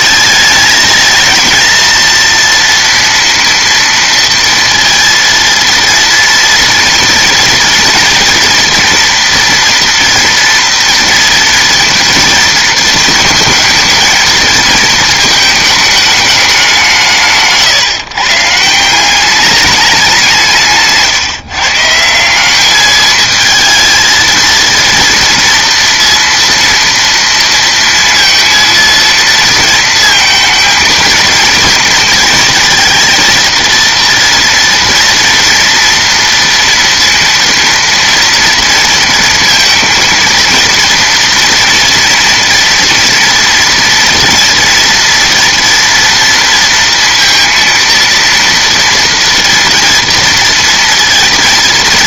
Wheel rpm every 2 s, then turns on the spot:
220, 230, 230, 230, 230, 230, 230, 230, 190, 160, 160, 210, 230, 230, 230, 230, 230, 230, 230, 230, 230, 230, 230, 230, 230, 230.
none